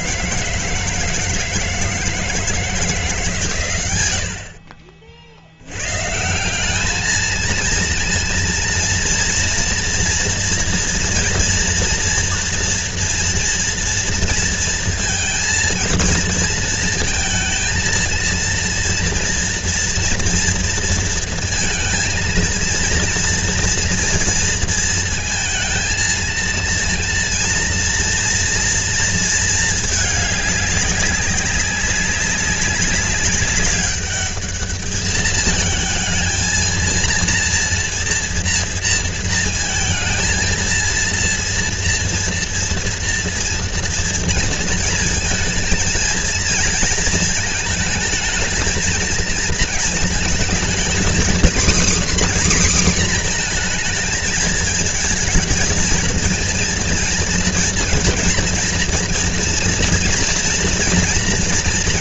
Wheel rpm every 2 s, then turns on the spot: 160, 160, 50, 210, 230, 230, 230, 230, 220, 230, 230, 230, 230, 230, 230, 200, 200, 210, 230, 230, 230, 230, 230, 230, 220, 230, 260, 220, 230, 230, 240.
none